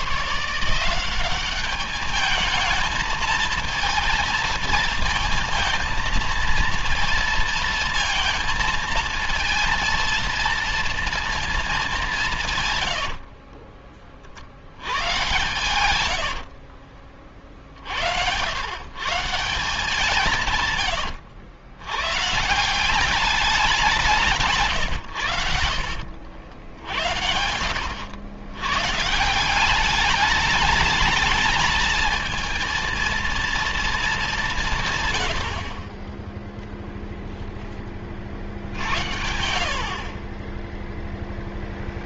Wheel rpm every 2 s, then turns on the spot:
160, 220, 230, 230, 230, 230, 150, 80, 70, 90, 150, 170, 160, 70, 110, 210, 230, 180, 0, 60, 20.
12-14 16-18 40-42